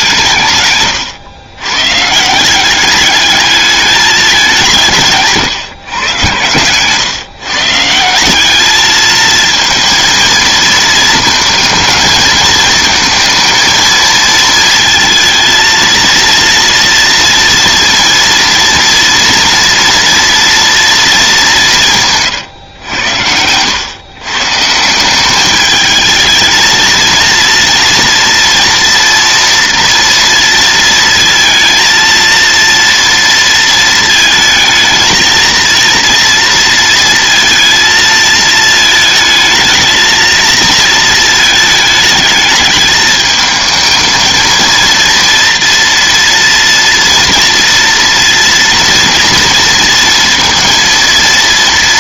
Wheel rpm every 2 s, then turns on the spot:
110, 200, 150, 130, 220, 230, 220, 230, 230, 230, 220, 100, 170, 230, 230, 230, 230, 220, 230, 220, 230, 220, 230, 230, 230, 230.
none